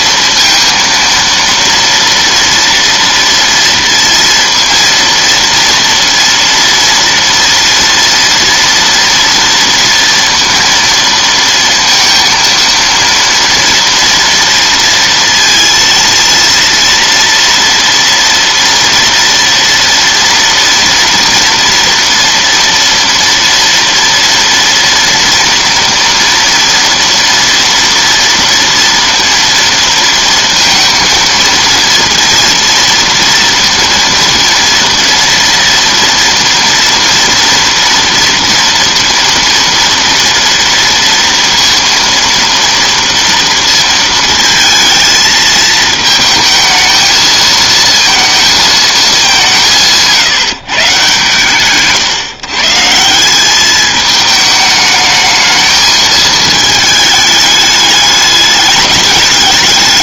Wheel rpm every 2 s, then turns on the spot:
230, 230, 230, 230, 230, 230, 230, 230, 230, 230, 230, 230, 230, 230, 230, 230, 230, 230, 230, 230, 230, 230, 220, 220, 220, 150, 160, 220, 220, 210.
none